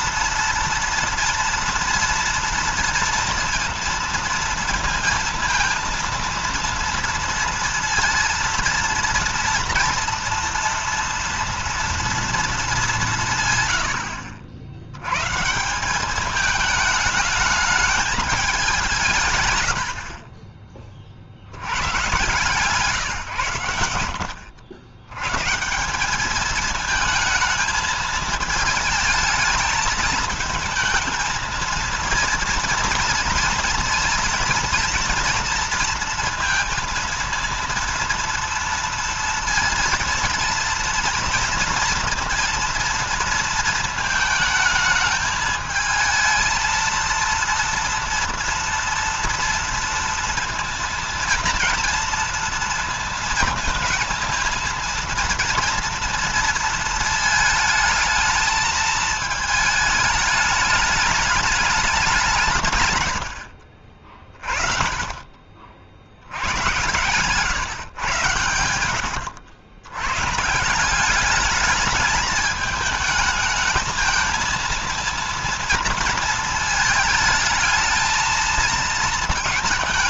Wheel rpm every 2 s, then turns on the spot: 230, 230, 230, 230, 230, 230, 210, 70, 210, 190, 30, 140, 80, 210, 220, 220, 230, 230, 230, 230, 230, 230, 220, 230, 230, 230, 230, 230, 230, 220, 210, 160, 30, 100, 100, 170, 210, 230, 220, 220.
66-68